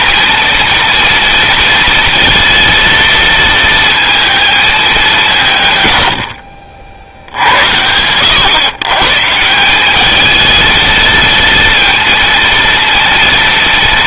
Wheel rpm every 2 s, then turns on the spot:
230, 230, 210, 80, 120, 220, 230.
none